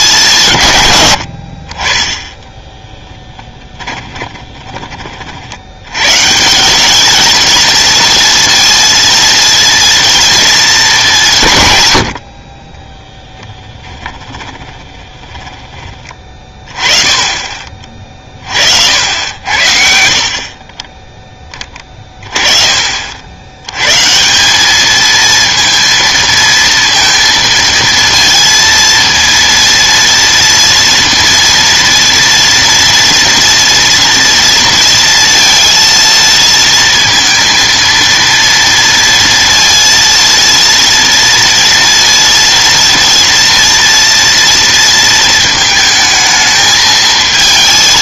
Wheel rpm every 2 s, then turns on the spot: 140, 10, 20, 170, 230, 220, 30, 20, 20, 50, 40, 30, 190, 230, 230, 230, 230, 230, 230, 230, 230, 230, 230, 220.
2-4 14-16